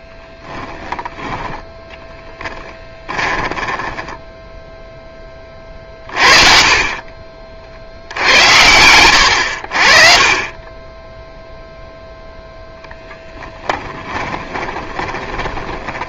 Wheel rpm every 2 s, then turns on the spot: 10, 20, 0, 40, 90, 20, 0, 20.
2-4 14-16